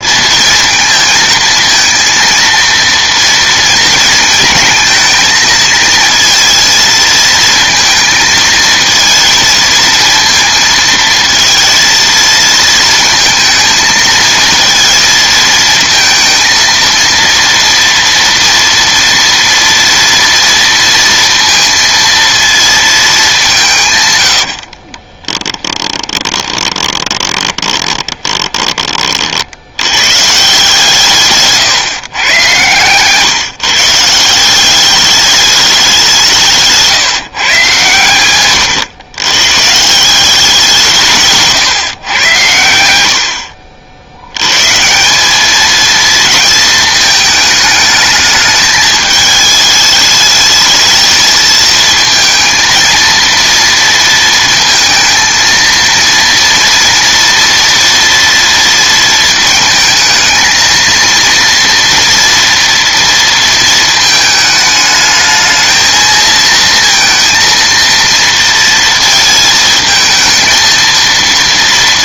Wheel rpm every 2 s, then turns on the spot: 230, 230, 230, 230, 220, 230, 220, 230, 230, 230, 230, 230, 70, 20, 20, 150, 130, 180, 160, 120, 180, 100, 130, 220, 210, 220, 230, 230, 230, 230, 220, 230, 220, 230, 230, 230.
24-30 36-38